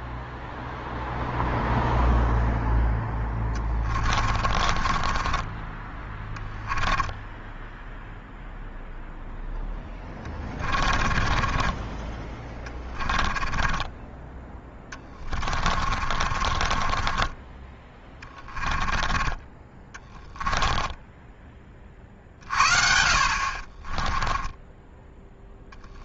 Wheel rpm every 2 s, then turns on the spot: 0, 0, 30, 10, 0, 30, 30, 20, 30, 10, 10, 50, 10.
4-8 10-22